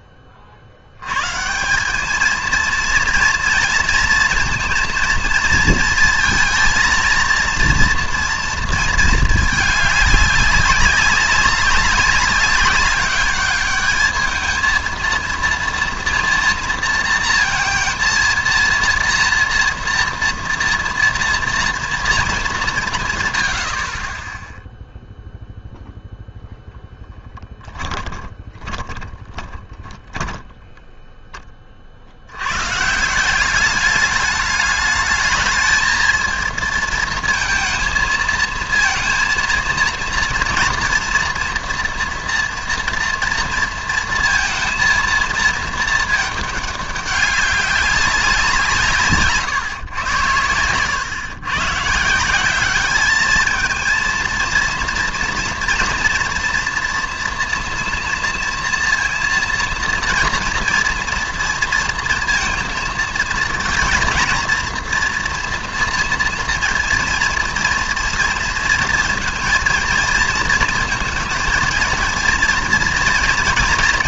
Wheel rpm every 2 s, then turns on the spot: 40, 230, 230, 230, 230, 200, 200, 220, 230, 230, 230, 200, 0, 0, 10, 10, 110, 210, 230, 230, 240, 240, 230, 210, 170, 100, 200, 230, 230, 230, 230, 230, 230, 230, 230, 230, 230.
28-32